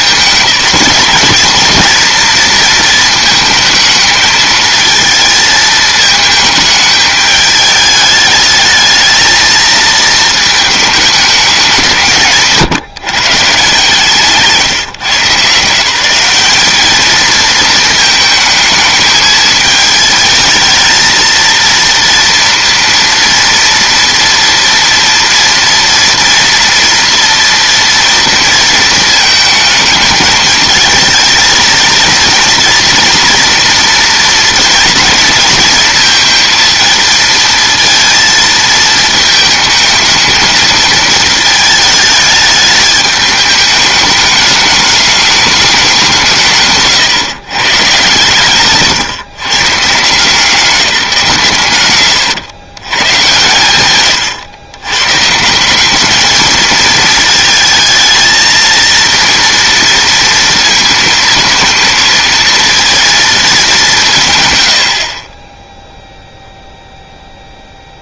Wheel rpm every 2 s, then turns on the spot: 210, 230, 220, 210, 210, 220, 150, 140, 210, 220, 220, 230, 230, 230, 230, 220, 230, 230, 230, 220, 220, 210, 210, 150, 130, 190, 120, 110, 220, 230, 230, 230, 100, 0.
46-50